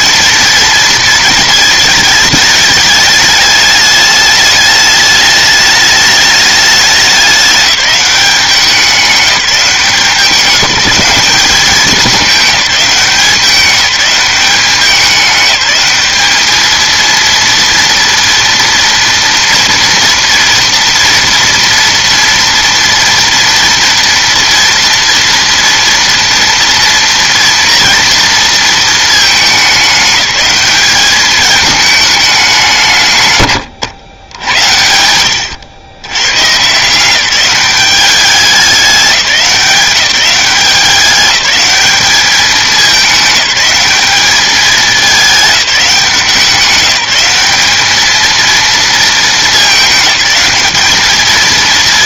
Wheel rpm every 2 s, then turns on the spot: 230, 210, 210, 210, 190, 200, 200, 190, 220, 230, 230, 230, 240, 230, 220, 210, 190, 90, 130, 200, 190, 200, 210, 180, 230, 210.
none